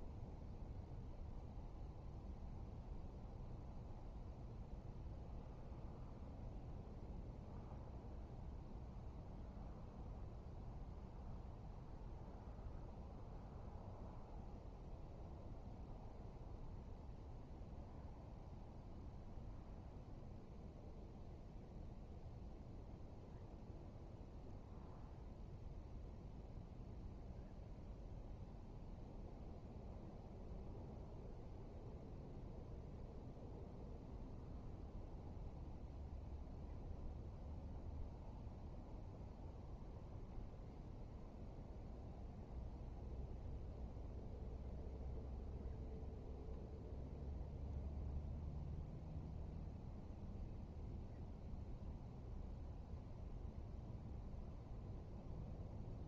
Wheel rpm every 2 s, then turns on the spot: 0, 0, 0, 0, 0, 0, 0, 0, 0, 0, 0, 0, 0, 0, 0, 0, 0, 0, 0, 0, 0, 0, 0, 0, 0, 0, 0, 0.
none